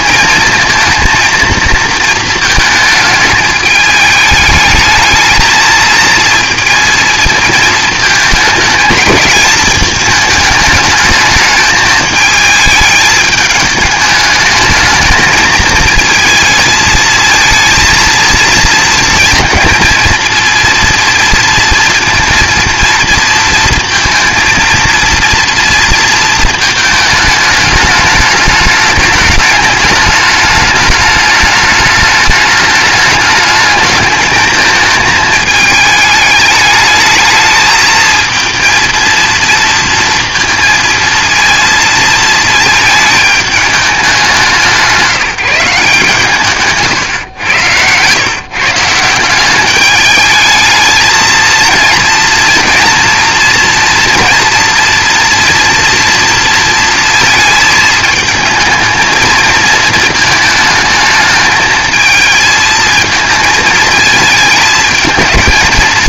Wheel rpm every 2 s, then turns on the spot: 230, 220, 210, 220, 220, 210, 220, 220, 220, 230, 230, 230, 230, 220, 210, 210, 210, 220, 210, 230, 230, 220, 180, 130, 150, 220, 230, 240, 230, 220, 220, 220, 220.
none